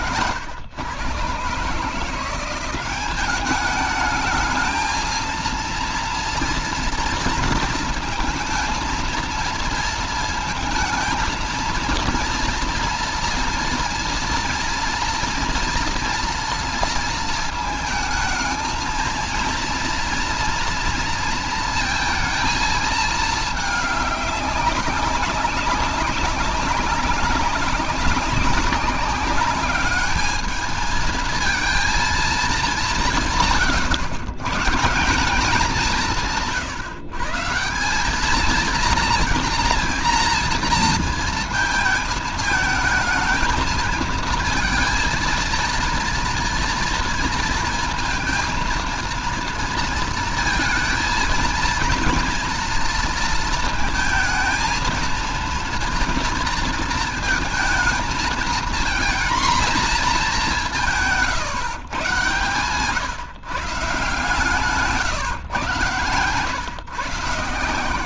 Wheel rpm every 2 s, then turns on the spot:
120, 180, 220, 230, 220, 230, 230, 240, 230, 220, 230, 220, 200, 200, 200, 210, 210, 140, 150, 220, 230, 220, 230, 230, 230, 230, 230, 230, 230, 230, 200, 130, 160, 130.
none